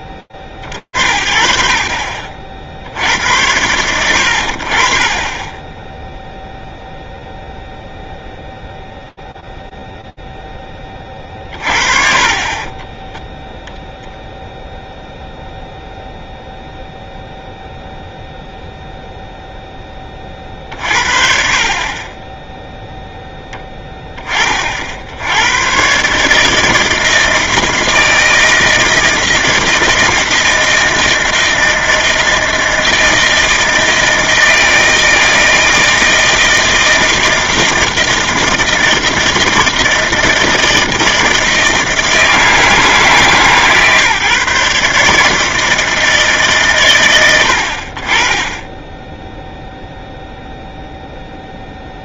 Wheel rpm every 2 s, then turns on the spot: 70, 60, 50, 0, 0, 30, 10, 0, 0, 0, 50, 10, 80, 160, 160, 160, 160, 160, 160, 160, 160, 160, 150, 110, 0, 0.
10-14